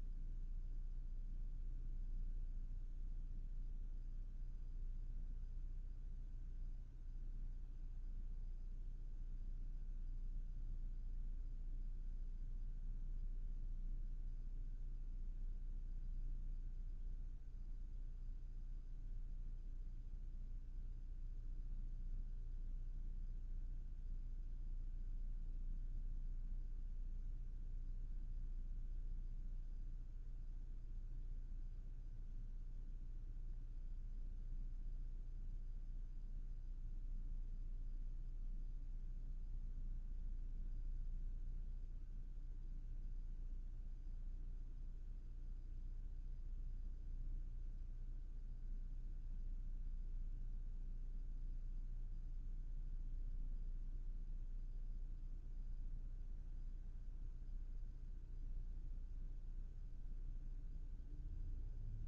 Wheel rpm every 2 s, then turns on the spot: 0, 0, 0, 0, 0, 0, 0, 0, 0, 0, 0, 0, 0, 0, 0, 0, 0, 0, 0, 0, 0, 0, 0, 0, 0, 0, 0, 0, 0, 0, 0.
none